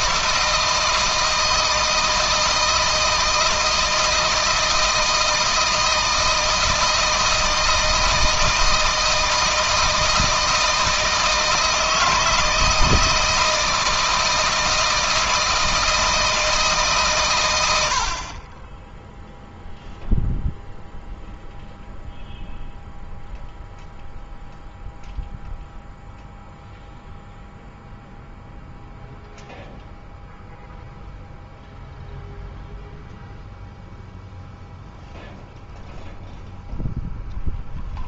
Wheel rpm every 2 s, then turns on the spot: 160, 160, 160, 160, 160, 160, 160, 160, 140, 10, 0, 0, 0, 0, 0, 0, 0, 0, 0.
none